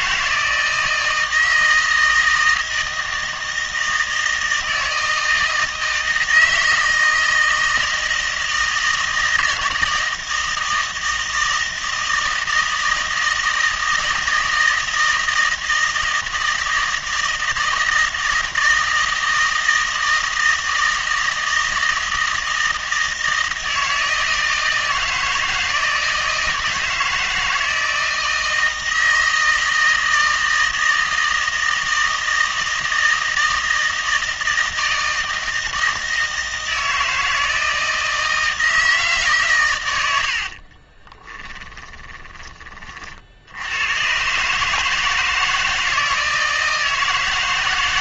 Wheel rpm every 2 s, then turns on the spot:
160, 160, 160, 160, 160, 160, 160, 160, 160, 160, 160, 160, 160, 160, 160, 160, 160, 160, 160, 160, 30, 30, 150, 160.
40-42